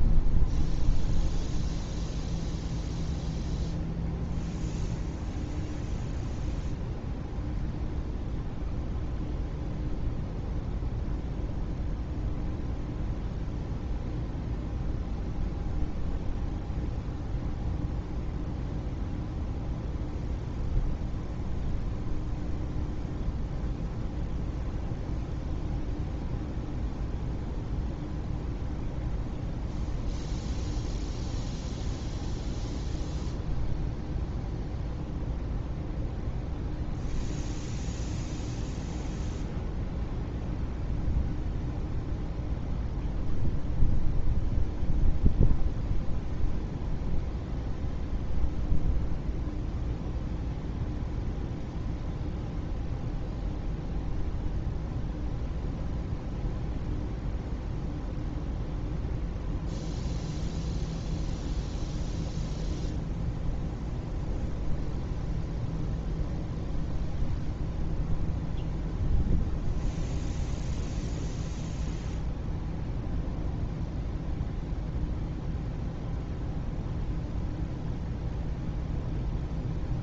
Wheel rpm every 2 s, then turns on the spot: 0, 0, 0, 0, 0, 0, 0, 0, 0, 0, 0, 0, 0, 0, 0, 0, 0, 0, 0, 0, 0, 0, 0, 0, 0, 0, 0, 0, 0, 0, 0, 0, 0, 0, 0, 0, 0, 0, 0, 0.
none